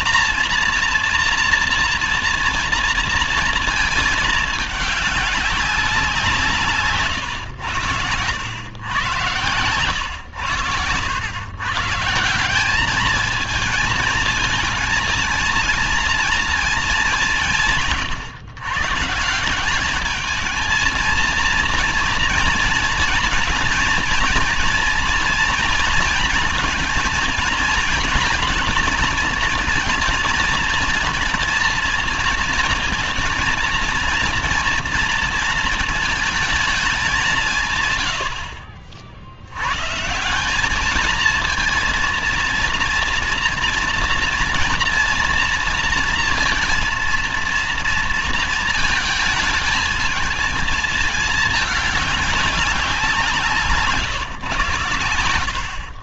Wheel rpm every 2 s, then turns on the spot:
230, 230, 210, 160, 100, 100, 190, 230, 220, 130, 220, 230, 230, 230, 220, 230, 230, 230, 210, 60, 200, 230, 230, 230, 220, 220, 190, 130.
10-12